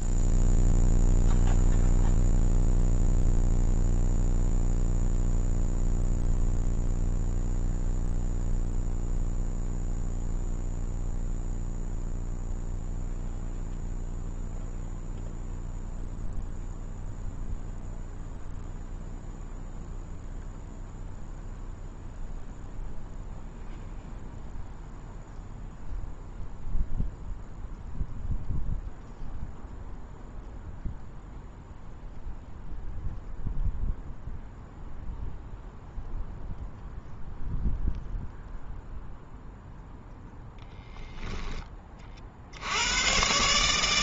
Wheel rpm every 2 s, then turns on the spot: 0, 0, 0, 0, 0, 0, 0, 0, 0, 0, 0, 0, 0, 0, 0, 0, 0, 0, 0, 0, 0, 90.
none